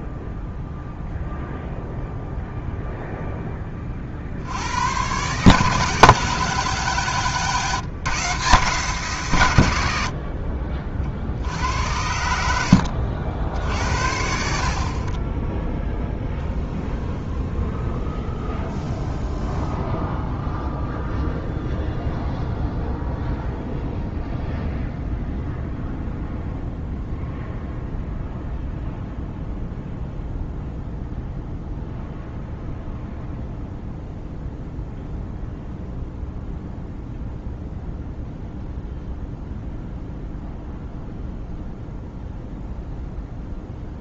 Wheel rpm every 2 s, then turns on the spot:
0, 0, 110, 150, 160, 50, 70, 40, 0, 0, 0, 0, 0, 0, 0, 0, 0, 0, 0, 0, 0, 0.
12-14